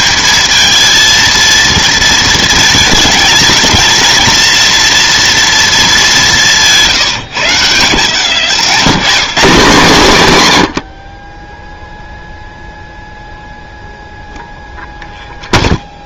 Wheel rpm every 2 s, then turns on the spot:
220, 220, 230, 170, 140, 110, 0, 0.
none